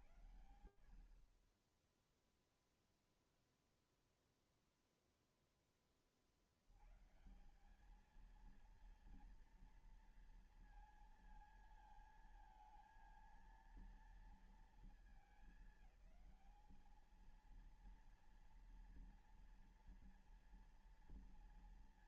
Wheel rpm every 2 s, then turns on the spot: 70, 0, 0, 50, 220, 230, 230, 220, 220, 240, 230.
none